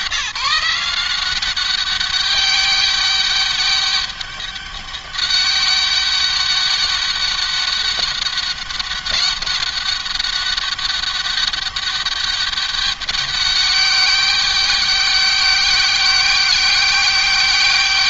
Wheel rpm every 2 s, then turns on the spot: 180, 200, 200, 200, 200, 200, 200, 200, 190.
none